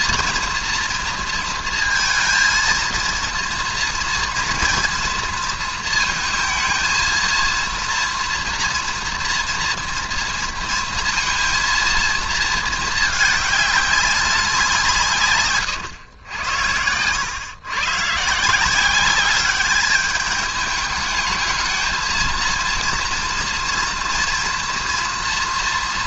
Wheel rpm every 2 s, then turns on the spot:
230, 230, 240, 230, 240, 230, 220, 170, 90, 170, 210, 230, 240.
none